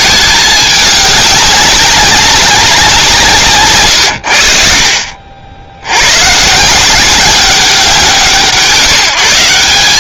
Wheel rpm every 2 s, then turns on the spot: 210, 180, 60, 170, 170.
none